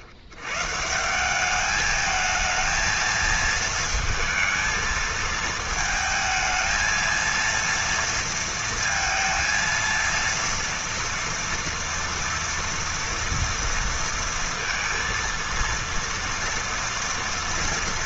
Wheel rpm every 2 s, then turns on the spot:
80, 220, 230, 220, 230, 230, 230, 230, 230.
none